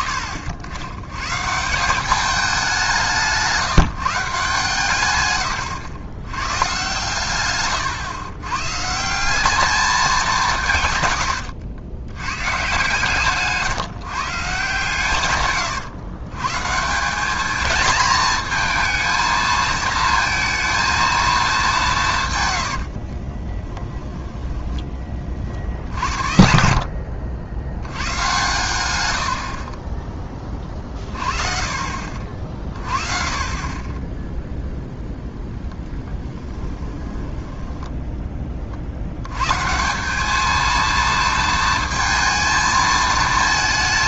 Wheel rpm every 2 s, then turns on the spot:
80, 190, 150, 110, 130, 150, 120, 150, 150, 220, 230, 110, 20, 60, 110, 30, 30, 0, 10, 40, 220, 220.
22-24 36-38